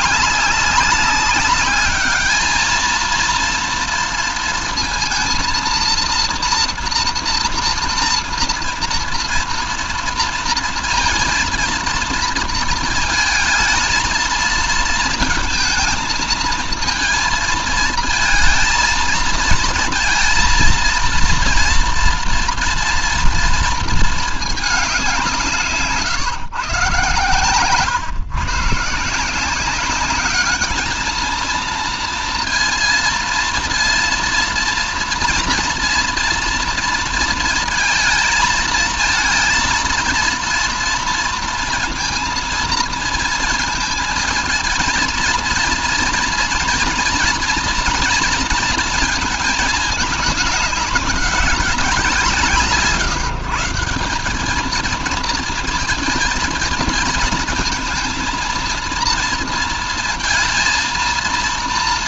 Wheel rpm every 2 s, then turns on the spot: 200, 220, 230, 240, 230, 230, 220, 220, 220, 220, 230, 240, 190, 130, 150, 220, 230, 230, 230, 220, 230, 230, 230, 230, 220, 200, 150, 220, 220, 230, 230.
none